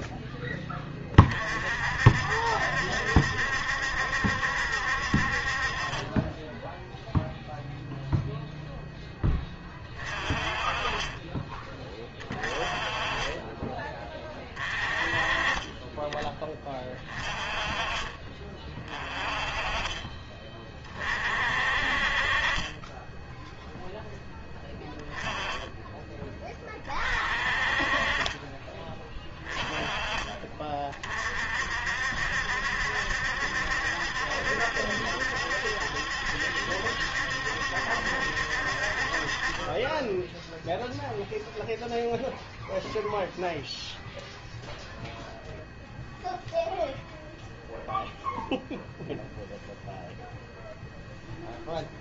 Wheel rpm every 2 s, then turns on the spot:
20, 70, 60, 0, 10, 20, 20, 30, 20, 30, 30, 20, 10, 30, 20, 40, 70, 70, 70, 40, 0, 0, 0, 0, 0, 0.
10-12 22-24